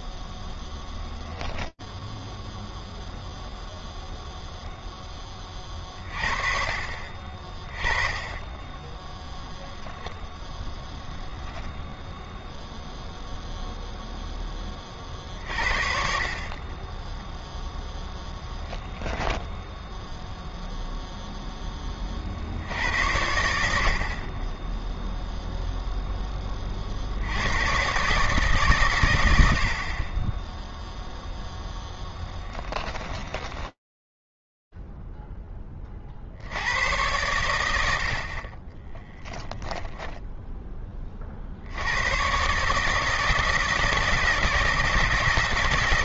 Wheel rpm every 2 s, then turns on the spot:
0, 0, 0, 50, 10, 0, 0, 50, 0, 10, 10, 80, 0, 80, 80, 0, 20, 0, 70, 40, 10, 130, 160.
8-10 32-34